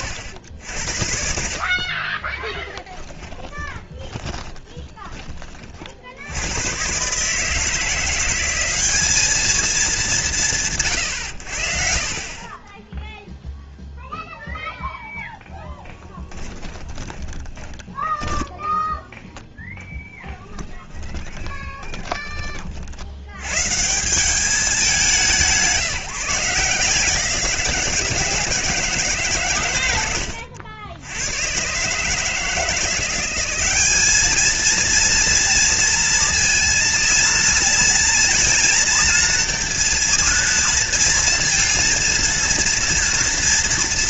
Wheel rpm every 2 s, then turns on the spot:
70, 10, 20, 110, 190, 140, 10, 0, 20, 10, 10, 50, 200, 160, 160, 80, 160, 220, 230, 230, 230, 230.
2-6 16-22